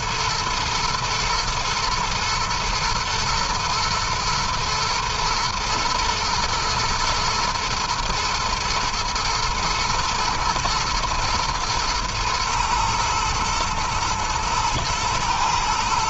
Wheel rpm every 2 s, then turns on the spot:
110, 120, 110, 120, 110, 110, 110, 120.
none